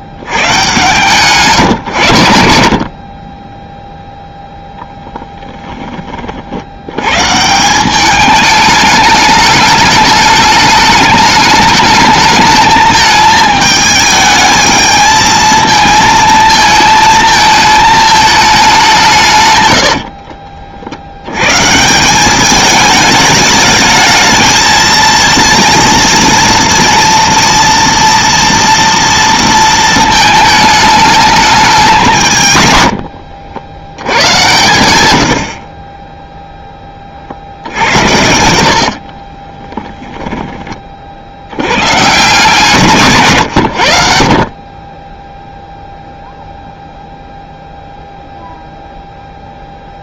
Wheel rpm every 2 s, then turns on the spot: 130, 60, 0, 70, 210, 210, 220, 220, 220, 200, 40, 210, 220, 230, 230, 220, 120, 100, 10, 80, 40, 150, 30, 0, 0.
38-40